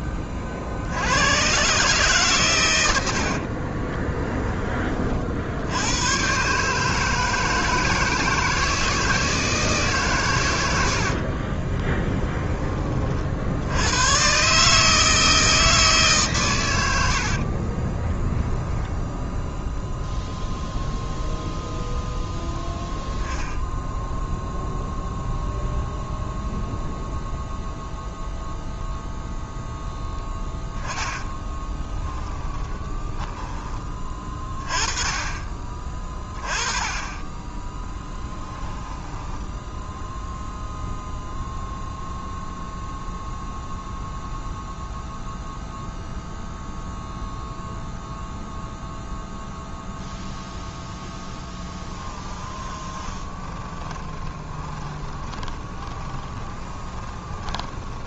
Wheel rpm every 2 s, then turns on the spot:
30, 110, 20, 140, 160, 100, 20, 140, 110, 0, 0, 10, 0, 0, 0, 10, 20, 30, 20, 10, 0, 0, 0, 0, 0, 0, 20, 20, 20.
30-34 38-40 52-58